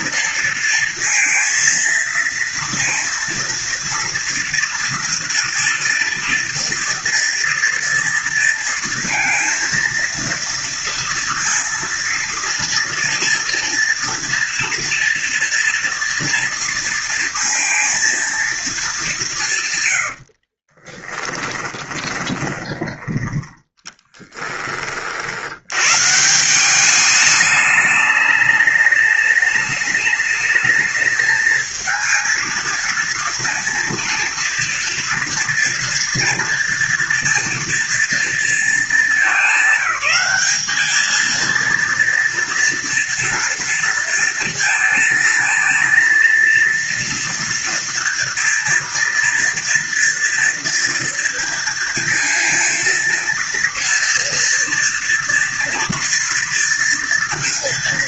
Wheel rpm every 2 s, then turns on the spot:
230, 230, 230, 230, 230, 230, 230, 230, 230, 180, 10, 10, 60, 200, 210, 220, 230, 230, 230, 220, 220, 230, 230, 230, 230, 230, 230, 230, 230.
20-22